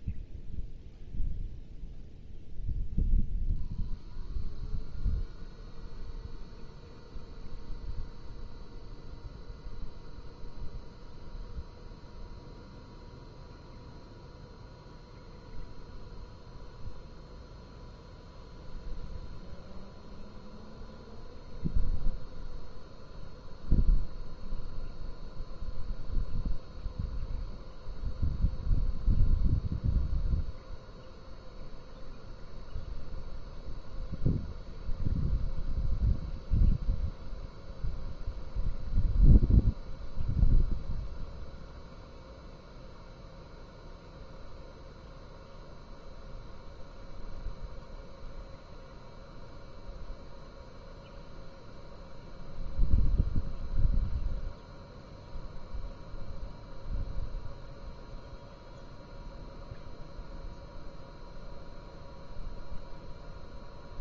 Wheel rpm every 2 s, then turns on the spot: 0, 0, 0, 0, 0, 0, 0, 0, 0, 0, 0, 0, 0, 0, 0, 0, 0, 0, 0, 0, 0, 0, 0, 0, 0, 0, 0, 0, 0, 0, 0, 0.
none